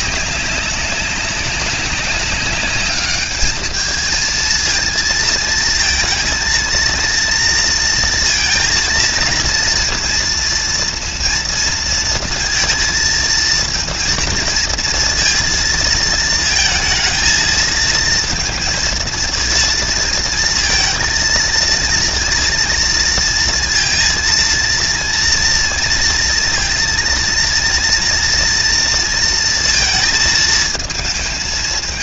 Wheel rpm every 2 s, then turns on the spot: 200, 210, 230, 230, 230, 230, 230, 230, 230, 230, 230, 230, 230, 230, 230, 220.
none